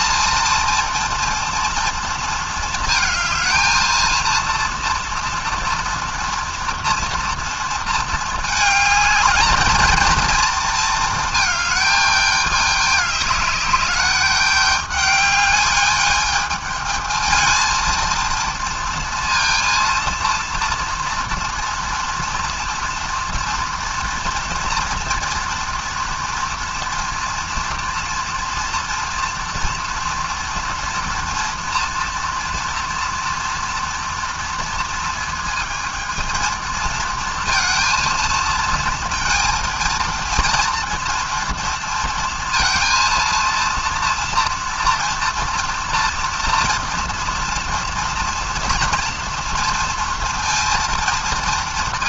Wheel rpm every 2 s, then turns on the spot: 230, 230, 230, 230, 210, 220, 210, 210, 220, 230, 230, 230, 230, 230, 240, 240, 240, 230, 230, 230, 230, 230, 240, 230, 230, 230.
none